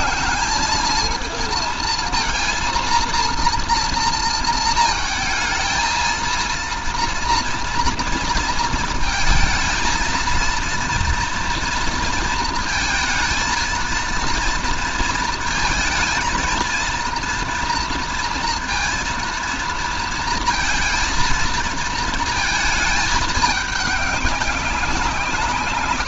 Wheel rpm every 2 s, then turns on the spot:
220, 230, 230, 230, 230, 230, 230, 230, 230, 230, 220, 220, 190.
none